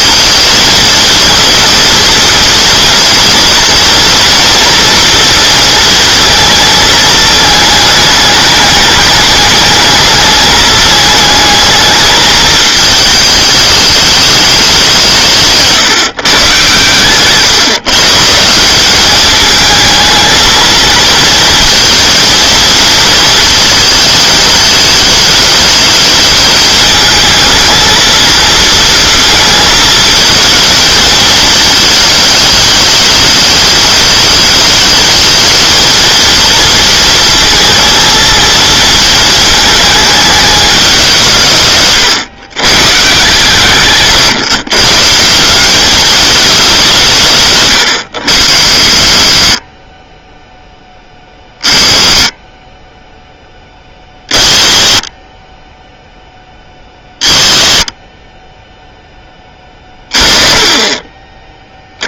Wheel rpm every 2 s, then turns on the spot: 220, 230, 230, 220, 210, 210, 210, 200, 140, 180, 220, 230, 220, 220, 230, 220, 210, 210, 230, 220, 200, 140, 140, 190, 70, 10, 10, 30, 10, 10, 30.
none